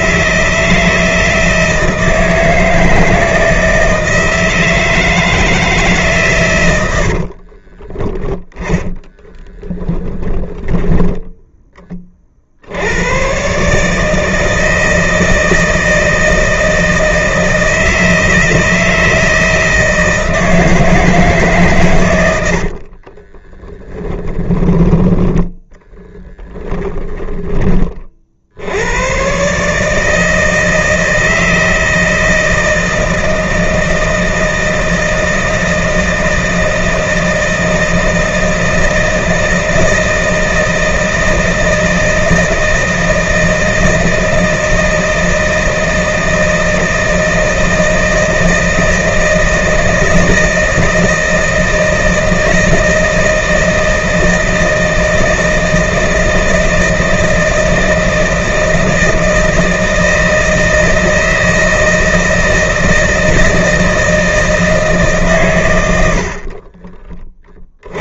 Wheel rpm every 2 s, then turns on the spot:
160, 160, 160, 70, 10, 10, 90, 160, 160, 160, 160, 40, 20, 10, 100, 160, 160, 160, 160, 160, 160, 160, 160, 160, 160, 160, 160, 160, 160, 160, 160, 160, 150, 40.
6-10 22-24 66-68